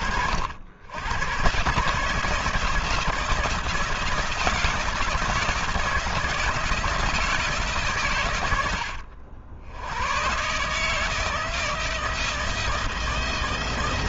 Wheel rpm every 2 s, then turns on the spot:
90, 160, 160, 170, 80, 150, 160.
none